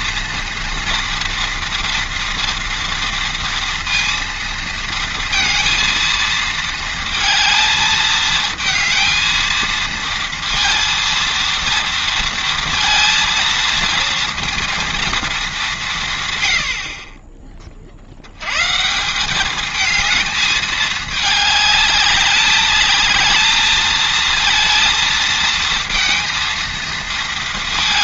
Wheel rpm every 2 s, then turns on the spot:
230, 230, 230, 230, 220, 230, 230, 230, 80, 130, 220, 210, 230, 230.
none